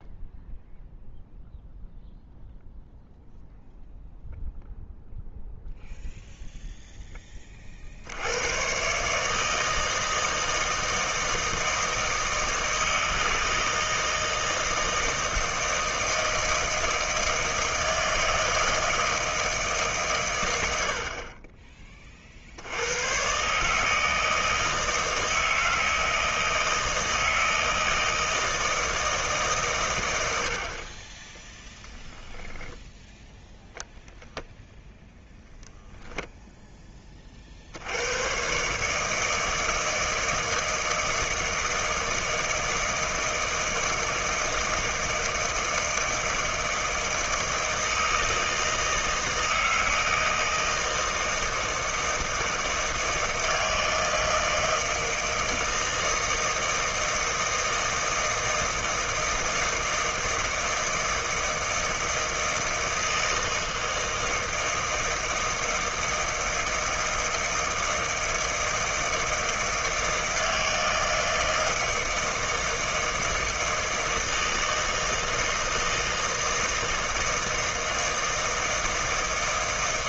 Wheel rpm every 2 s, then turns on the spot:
0, 0, 0, 0, 120, 160, 160, 160, 160, 160, 90, 80, 160, 160, 160, 60, 10, 0, 10, 140, 160, 160, 160, 160, 160, 160, 160, 160, 160, 160, 160, 160, 160, 160, 160, 160, 160, 160, 160, 160.
none